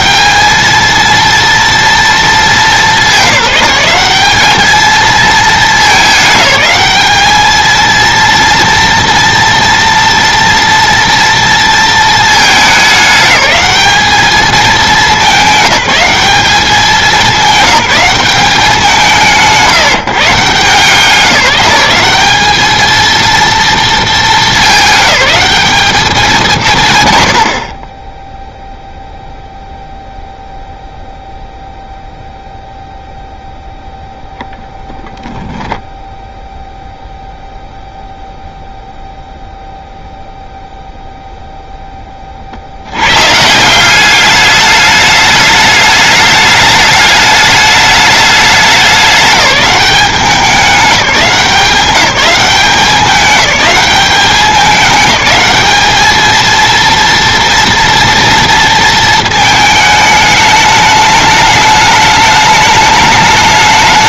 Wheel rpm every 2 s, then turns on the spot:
230, 200, 220, 210, 230, 230, 210, 210, 200, 180, 180, 220, 200, 130, 0, 0, 0, 10, 0, 0, 0, 100, 210, 210, 200, 190, 200, 200, 230, 230, 210, 210.
none